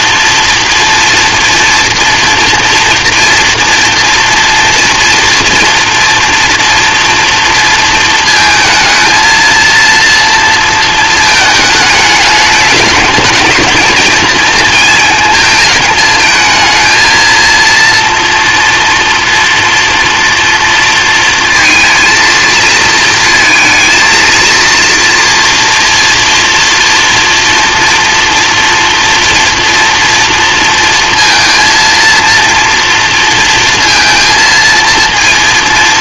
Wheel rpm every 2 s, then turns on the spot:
230, 240, 230, 230, 220, 230, 210, 220, 230, 230, 230, 220, 230, 230, 230, 230, 230, 230.
none